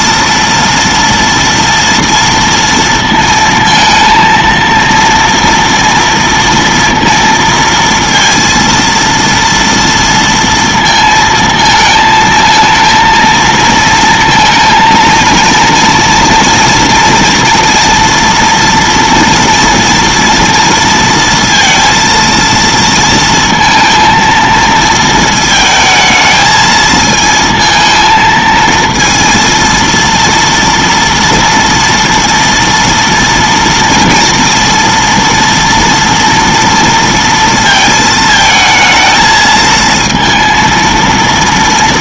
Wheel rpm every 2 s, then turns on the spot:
230, 230, 230, 230, 230, 230, 220, 230, 230, 230, 230, 230, 230, 220, 220, 230, 230, 230, 230, 230, 220.
none